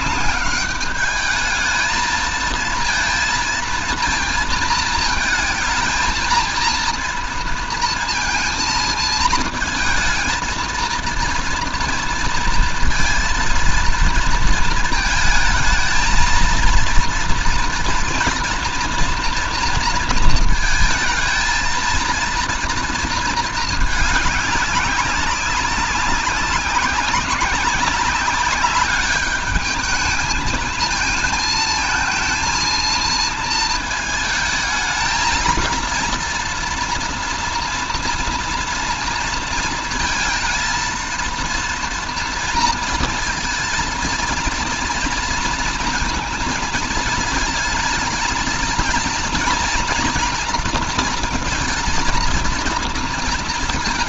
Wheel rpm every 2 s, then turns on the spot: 200, 220, 220, 230, 230, 230, 230, 230, 230, 230, 220, 230, 200, 190, 200, 220, 230, 220, 230, 230, 220, 230, 230, 220, 220, 230, 230.
none